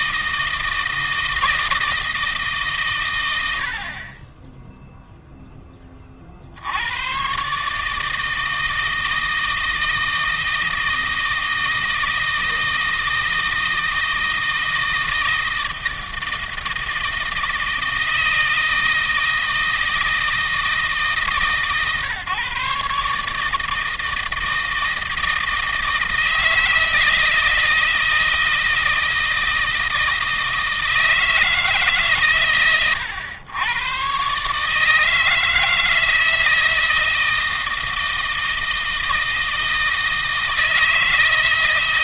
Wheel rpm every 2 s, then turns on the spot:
160, 120, 0, 100, 160, 160, 160, 160, 160, 160, 150, 140, 160, 160, 160, 160, 110, 150, 160, 160, 160.
none